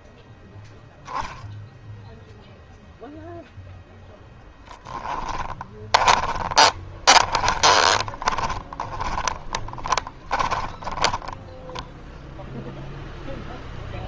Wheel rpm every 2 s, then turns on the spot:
0, 10, 30, 30, 30, 0, 0.
2-10